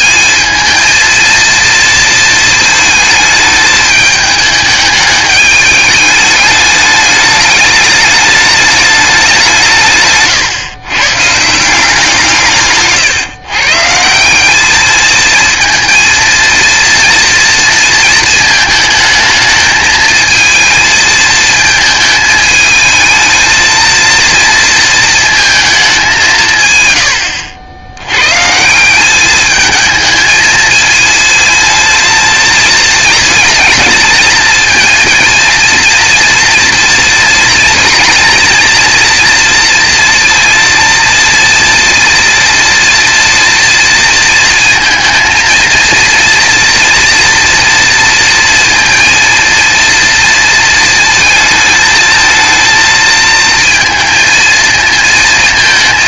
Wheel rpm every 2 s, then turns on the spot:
230, 220, 210, 210, 210, 130, 160, 200, 230, 220, 230, 220, 230, 150, 150, 220, 220, 220, 230, 230, 230, 230, 230, 230, 230, 230, 220, 220.
none